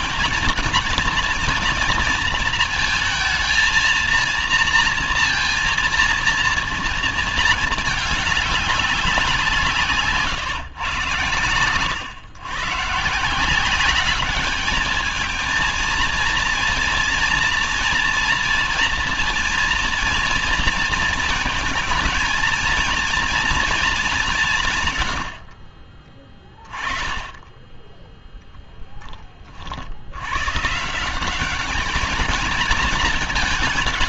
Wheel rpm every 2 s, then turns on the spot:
230, 220, 230, 230, 190, 120, 130, 210, 230, 230, 230, 230, 140, 20, 10, 160, 200.
none